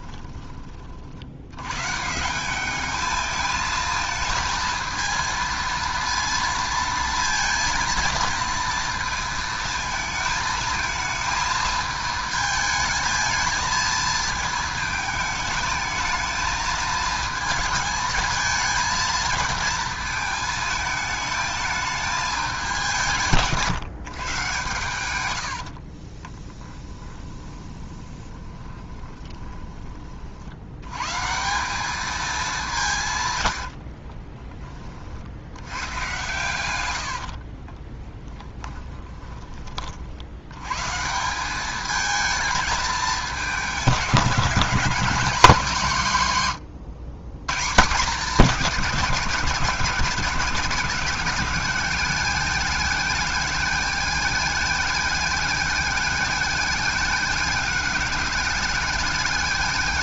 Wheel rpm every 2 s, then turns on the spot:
50, 210, 220, 230, 230, 220, 220, 220, 220, 220, 220, 170, 120, 20, 20, 90, 170, 30, 90, 10, 120, 220, 180, 110, 200, 190, 210, 210, 210, 210.
26-30 36-40